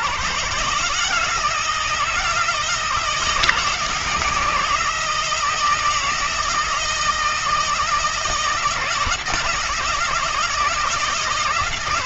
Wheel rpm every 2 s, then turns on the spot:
160, 160, 160, 160, 160, 160.
none